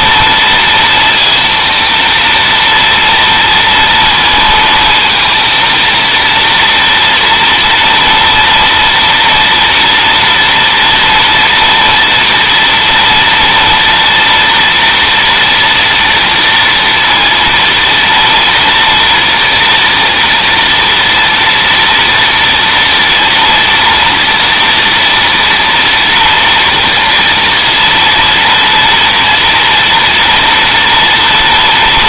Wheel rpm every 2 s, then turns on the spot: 230, 230, 230, 230, 230, 230, 230, 240, 230, 230, 230, 230, 230, 230, 230, 230.
none